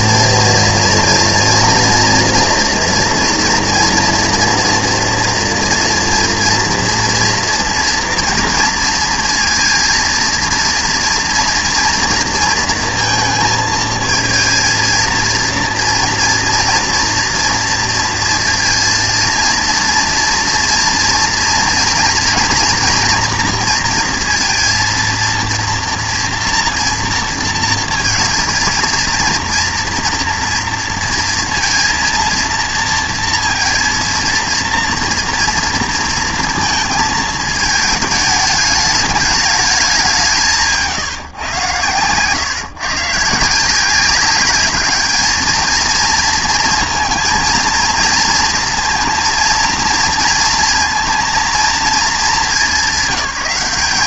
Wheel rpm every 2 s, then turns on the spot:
230, 230, 240, 240, 230, 230, 230, 230, 230, 230, 230, 240, 230, 230, 230, 230, 230, 230, 230, 210, 170, 140, 200, 230, 230, 230, 210.
none